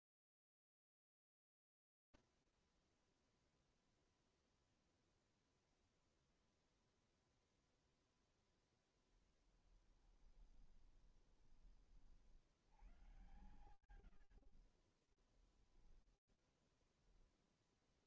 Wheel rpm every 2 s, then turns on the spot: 0, 0, 0, 0, 0, 10, 50, 40, 0.
10-12 14-16